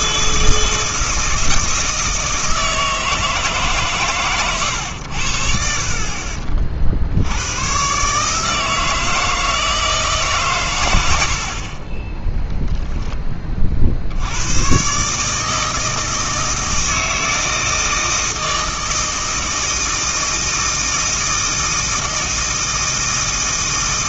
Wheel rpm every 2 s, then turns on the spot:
160, 160, 100, 70, 160, 110, 10, 120, 160, 160, 160, 160.
none